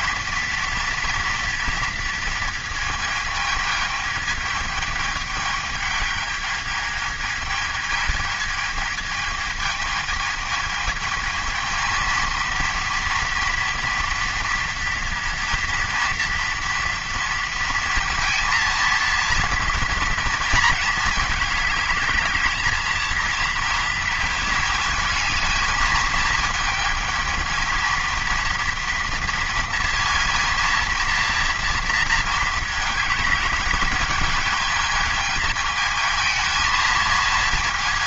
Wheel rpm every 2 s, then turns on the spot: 230, 220, 220, 220, 220, 220, 230, 230, 230, 230, 220, 220, 220, 220, 230, 230, 220, 220, 220.
none